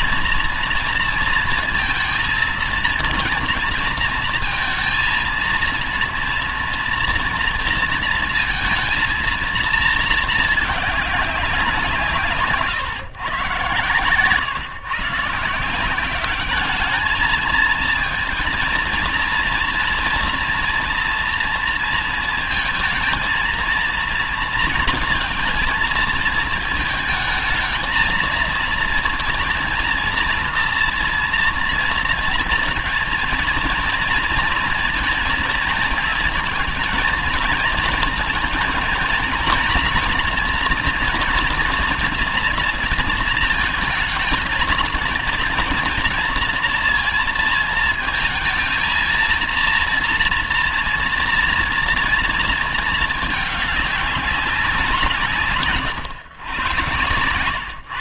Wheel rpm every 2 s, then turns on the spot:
230, 230, 230, 230, 230, 220, 150, 140, 200, 230, 230, 220, 230, 220, 230, 240, 230, 230, 230, 230, 240, 230, 220, 230, 230, 230, 230, 180, 120.
none